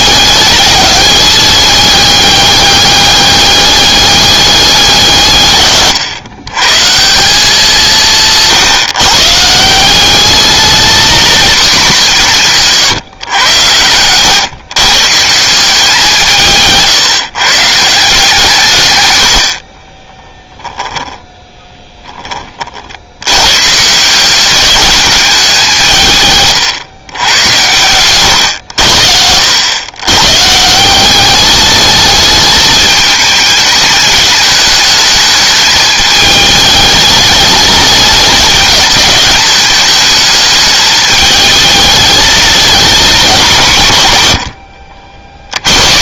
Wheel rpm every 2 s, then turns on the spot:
210, 200, 170, 170, 150, 230, 150, 130, 140, 130, 10, 70, 200, 120, 80, 180, 210, 210, 210, 210, 220, 220, 80.
none